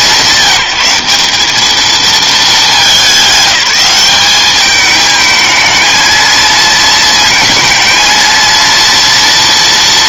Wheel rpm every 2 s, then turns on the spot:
180, 180, 220, 230, 230.
none